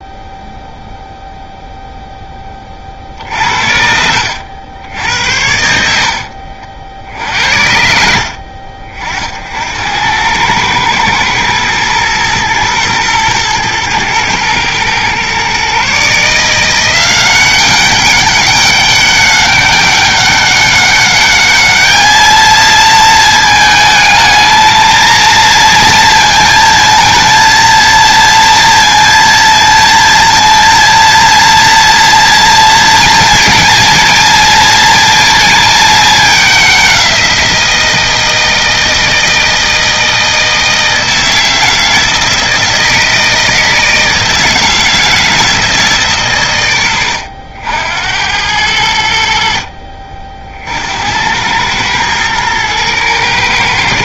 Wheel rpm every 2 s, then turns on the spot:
0, 50, 80, 60, 50, 110, 120, 120, 180, 200, 200, 220, 230, 230, 230, 230, 230, 230, 190, 160, 160, 160, 160, 100, 80, 60, 110.
none